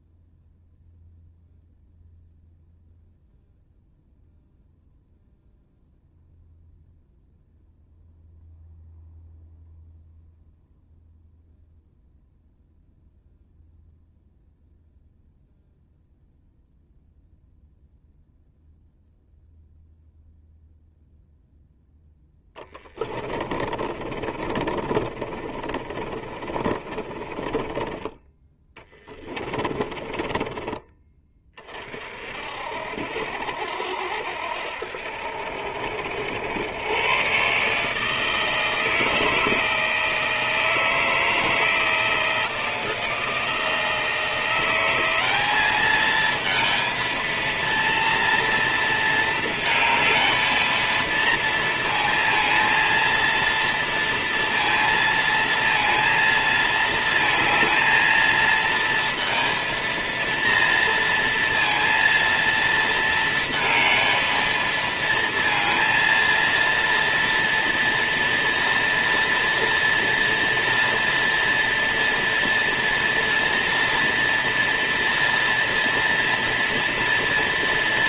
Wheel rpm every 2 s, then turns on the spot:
0, 0, 0, 0, 0, 0, 0, 0, 0, 0, 0, 20, 40, 30, 10, 20, 60, 70, 110, 160, 160, 160, 180, 230, 230, 220, 230, 230, 220, 230, 230, 230, 230, 230, 230, 230, 230, 230, 230.
22-30